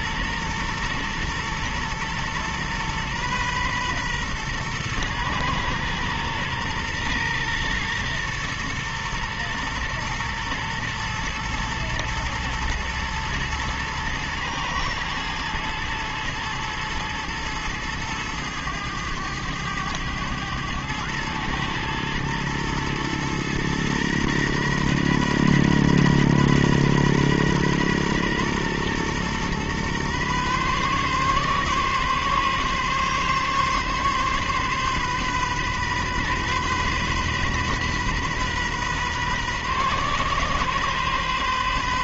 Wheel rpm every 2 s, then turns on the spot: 120, 120, 120, 120, 120, 120, 120, 110, 110, 110, 110, 120, 120, 120, 120, 130, 140, 130, 130, 130, 130.
none